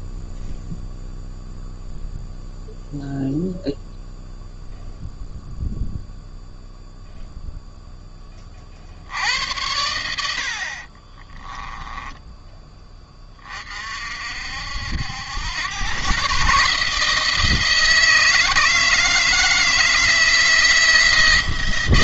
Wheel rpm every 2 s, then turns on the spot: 0, 0, 0, 0, 60, 50, 10, 70, 150, 160, 160.
10-12